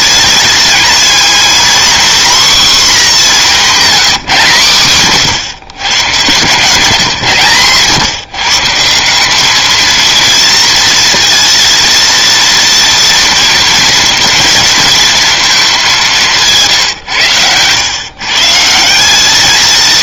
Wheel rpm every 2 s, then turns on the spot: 230, 240, 120, 160, 180, 230, 230, 230, 140, 180.
none